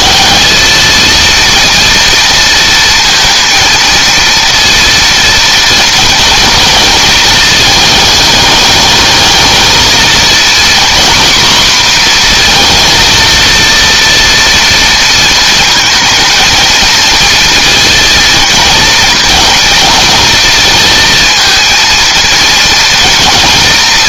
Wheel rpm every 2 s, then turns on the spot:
220, 230, 230, 220, 210, 240, 230, 230, 230, 230, 230, 230.
none